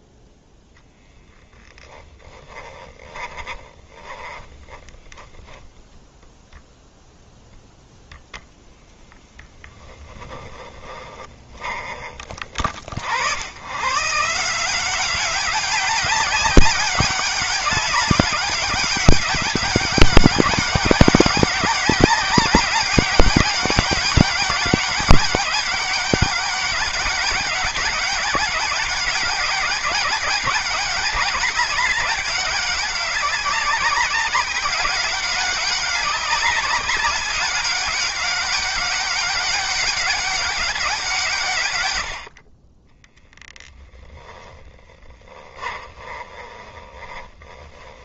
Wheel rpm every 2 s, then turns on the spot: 0, 20, 20, 0, 0, 20, 60, 180, 200, 200, 190, 200, 200, 190, 190, 200, 200, 200, 200, 200, 190, 20, 10, 20.
2-6 10-12 42-48